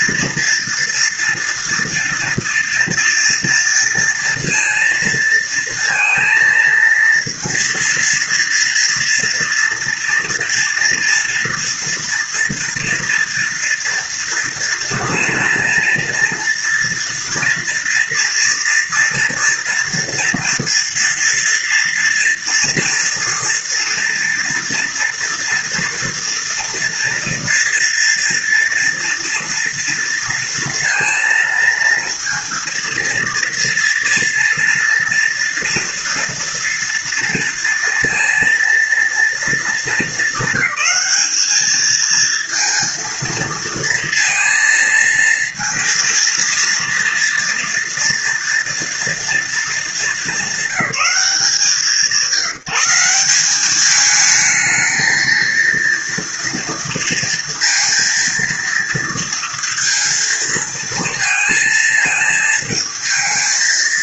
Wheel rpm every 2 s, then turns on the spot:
230, 230, 230, 230, 230, 230, 230, 230, 230, 230, 230, 230, 230, 240, 230, 230, 230, 230, 230, 230, 220, 230, 230, 230, 230, 200, 180, 220, 230, 230, 230, 220.
none